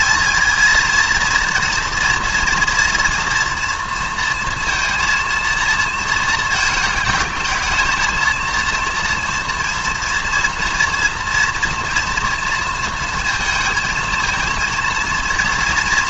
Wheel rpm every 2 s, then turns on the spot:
220, 240, 230, 230, 230, 230, 230, 230.
none